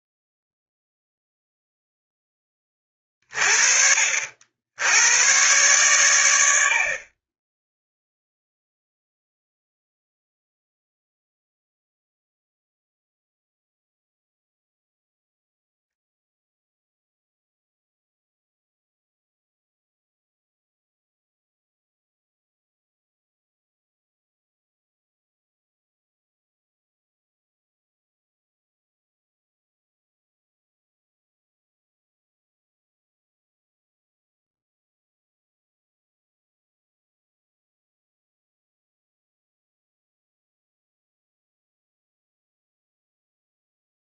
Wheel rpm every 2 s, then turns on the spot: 0, 20, 70, 90, 0, 0, 0, 0, 0, 0, 0, 0, 0, 0, 0, 0, 0, 0, 0, 0, 0, 0.
none